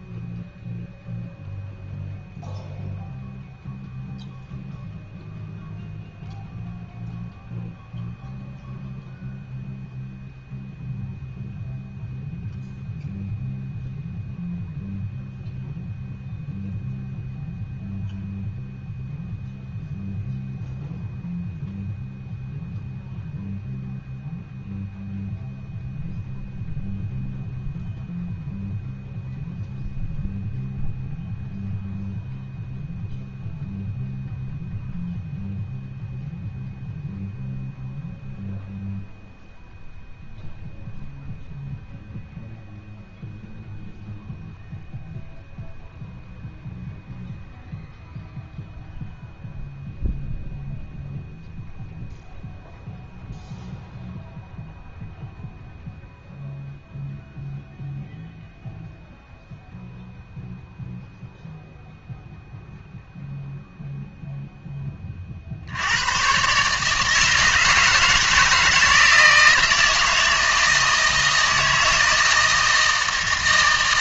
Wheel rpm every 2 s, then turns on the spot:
0, 0, 0, 0, 0, 0, 0, 0, 0, 0, 0, 0, 0, 0, 0, 0, 0, 0, 0, 0, 0, 0, 0, 0, 0, 0, 0, 0, 0, 0, 0, 0, 10, 140, 160, 160, 160.
none